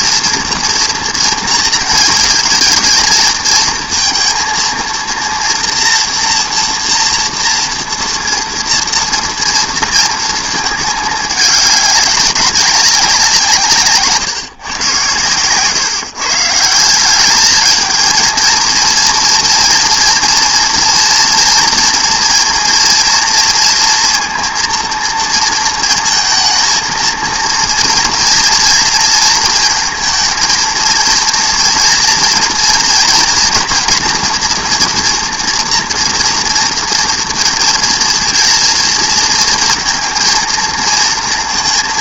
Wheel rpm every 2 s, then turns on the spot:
230, 230, 230, 230, 230, 220, 200, 130, 160, 230, 230, 230, 230, 220, 230, 230, 230, 240, 230, 230, 230.
none